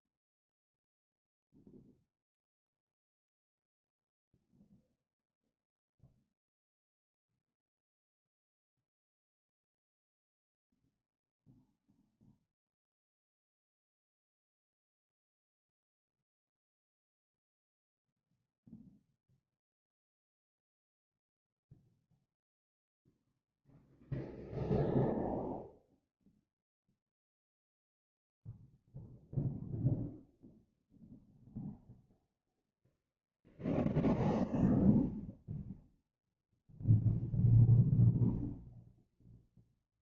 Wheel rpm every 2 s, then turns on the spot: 0, 0, 0, 0, 0, 0, 0, 0, 0, 0, 0, 0, 0, 0, 0, 0, 0, 0, 0, 0.
none